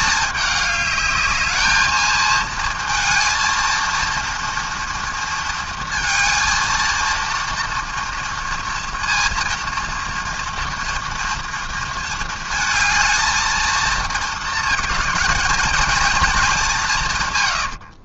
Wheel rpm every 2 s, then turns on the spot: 210, 230, 230, 230, 230, 230, 220, 220, 210.
none